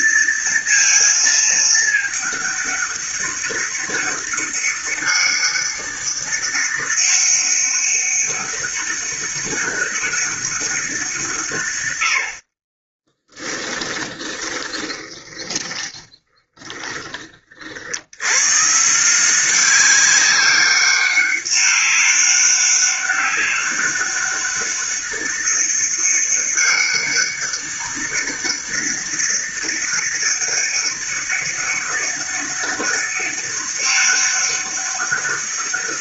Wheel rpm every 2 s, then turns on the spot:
230, 200, 200, 200, 200, 170, 20, 20, 30, 170, 200, 200, 200, 200, 200, 200, 200, 200.
12-16